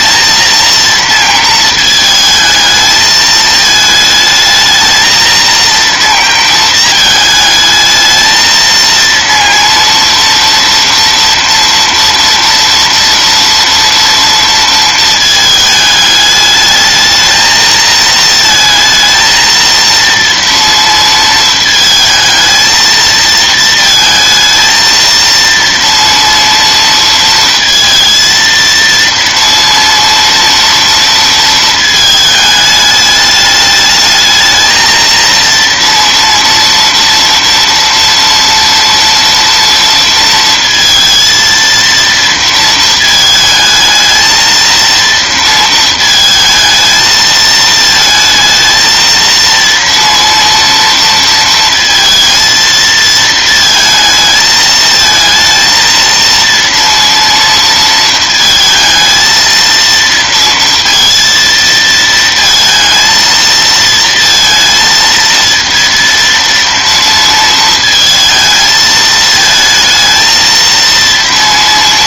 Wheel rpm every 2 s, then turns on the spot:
230, 220, 220, 220, 230, 230, 230, 230, 210, 230, 230, 220, 220, 230, 230, 230, 210, 220, 230, 230, 230, 220, 230, 220, 220, 230, 230, 220, 230, 220, 230, 230, 230, 230, 220, 230.
none